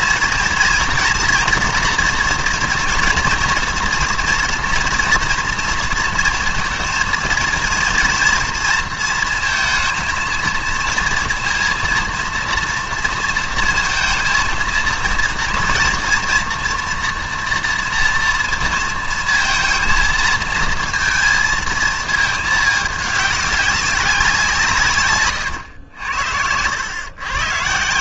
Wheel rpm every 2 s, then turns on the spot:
230, 230, 240, 230, 230, 230, 230, 230, 240, 230, 230, 220, 170, 100.
none